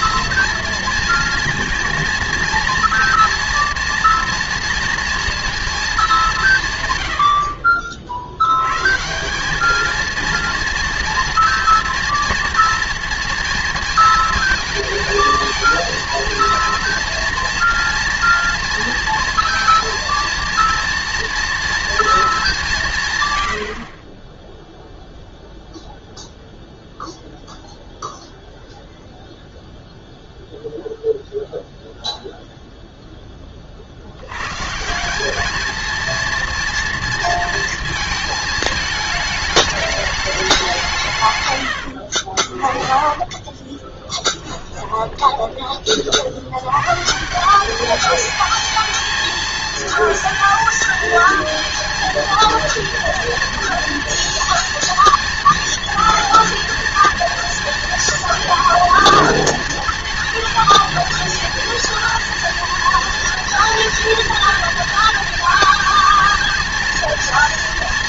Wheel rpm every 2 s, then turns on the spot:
230, 230, 230, 160, 100, 230, 230, 230, 230, 230, 230, 190, 0, 0, 0, 0, 0, 130, 230, 220, 200, 50, 20, 100, 220, 220, 230, 230, 230, 230, 230, 230, 230, 230.
42-46